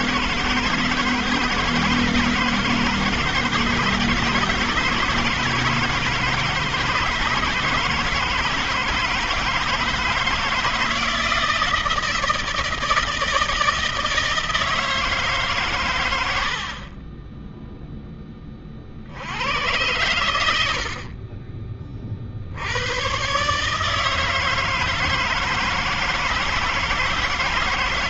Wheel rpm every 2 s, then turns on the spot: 160, 160, 160, 160, 160, 160, 160, 160, 120, 10, 100, 30, 150, 160.
none